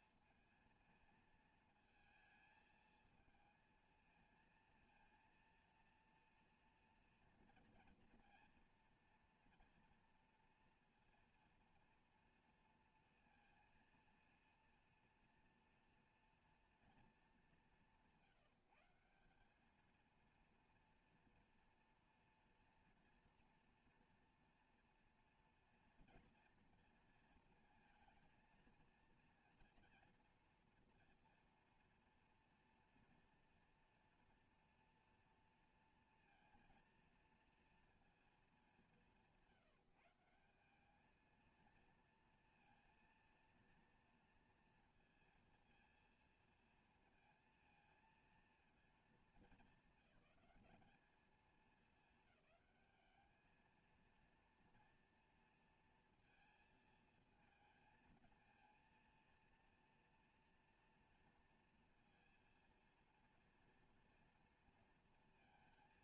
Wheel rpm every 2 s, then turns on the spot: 230, 220, 230, 230, 230, 230, 230, 230, 230, 180, 230, 230, 230, 230, 230, 230, 230, 230, 230, 210, 180, 230, 230, 230, 230, 200, 210, 230, 230, 230, 240, 230, 230.
none